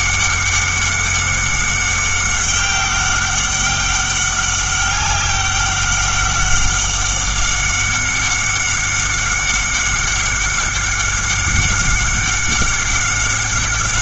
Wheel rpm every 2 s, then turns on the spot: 190, 200, 200, 190, 190, 190, 190.
none